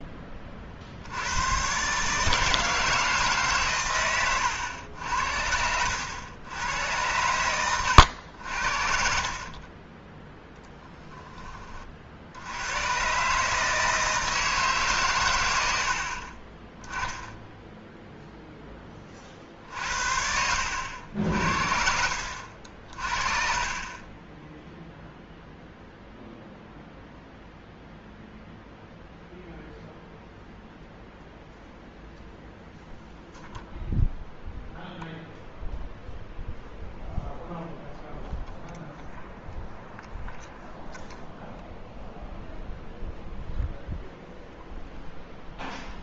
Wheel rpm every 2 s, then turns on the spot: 40, 160, 90, 100, 60, 10, 100, 150, 20, 10, 70, 50, 0, 0, 0, 0, 0, 0, 0, 0, 0, 0, 0.
10-12